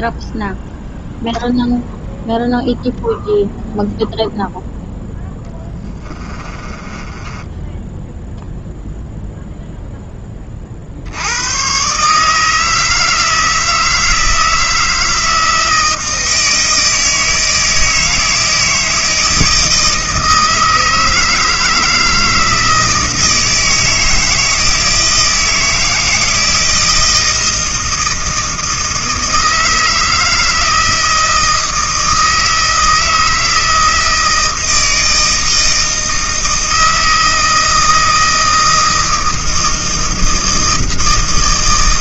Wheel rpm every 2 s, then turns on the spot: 0, 0, 0, 20, 0, 40, 160, 160, 160, 160, 160, 160, 160, 160, 160, 160, 160, 160, 160, 160, 160.
6-8